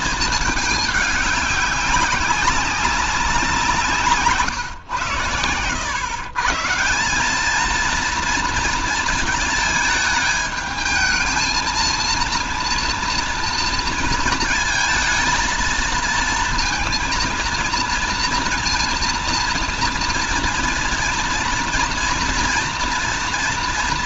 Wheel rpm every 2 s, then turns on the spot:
220, 200, 140, 150, 230, 210, 230, 230, 230, 230, 230, 230.
none